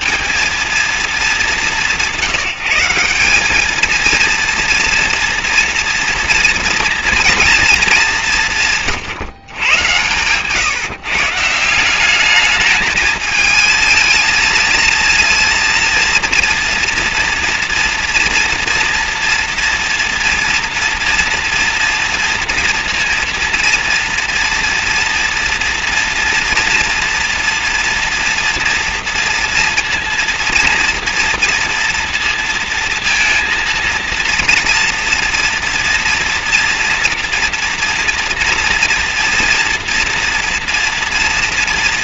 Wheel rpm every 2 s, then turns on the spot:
220, 180, 230, 240, 170, 140, 210, 230, 230, 230, 240, 230, 230, 240, 230, 240, 230, 230, 230, 230, 230.
none